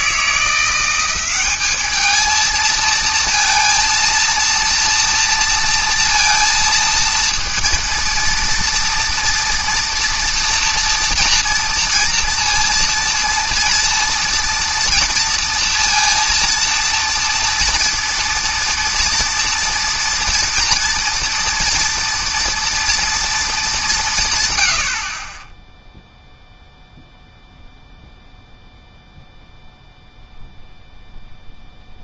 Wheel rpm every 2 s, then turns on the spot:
170, 230, 230, 230, 230, 230, 230, 230, 230, 230, 240, 230, 100, 0, 0, 0.
none